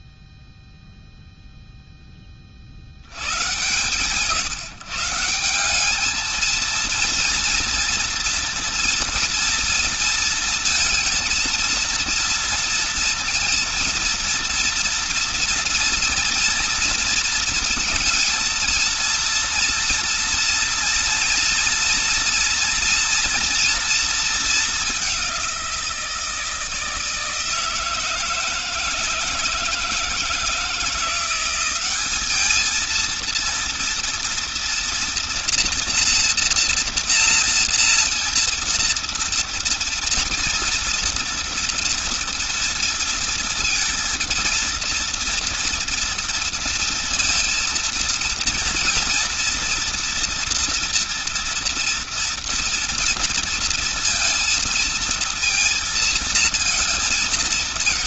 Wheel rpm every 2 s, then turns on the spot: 0, 20, 160, 230, 230, 230, 230, 230, 230, 230, 230, 240, 210, 160, 160, 160, 210, 230, 240, 230, 230, 230, 230, 230, 230, 230, 230, 230, 220.
none